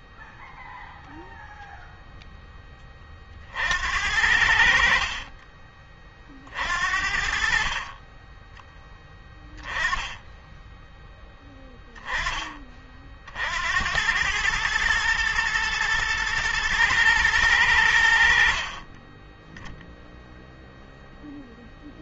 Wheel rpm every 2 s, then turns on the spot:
0, 30, 50, 50, 10, 10, 40, 110, 110, 30, 0.
none